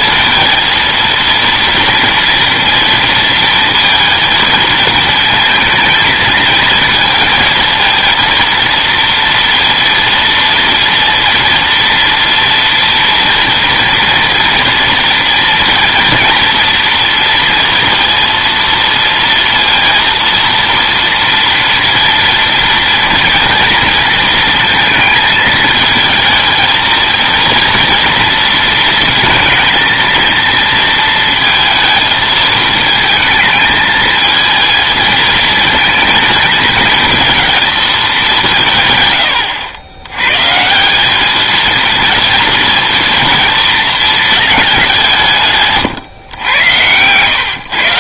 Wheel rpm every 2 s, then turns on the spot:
230, 230, 220, 220, 230, 230, 230, 230, 240, 230, 230, 230, 230, 230, 230, 230, 220, 220, 220, 150, 170, 230, 200, 100.
none